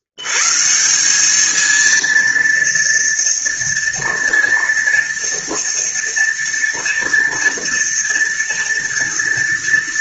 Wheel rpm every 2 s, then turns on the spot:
170, 230, 230, 230, 230.
none